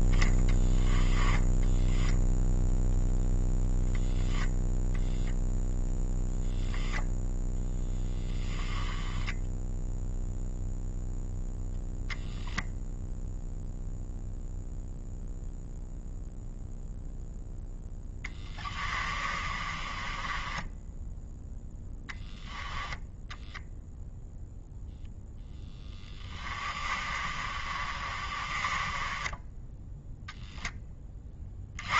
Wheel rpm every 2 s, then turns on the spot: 10, 0, 0, 0, 0, 0, 0, 0, 0, 20, 0, 0, 0, 30, 20, 20.
18-20 26-30